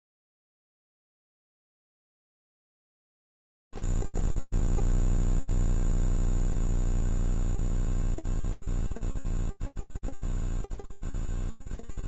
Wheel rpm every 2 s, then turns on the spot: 0, 0, 0, 0, 0, 0.
none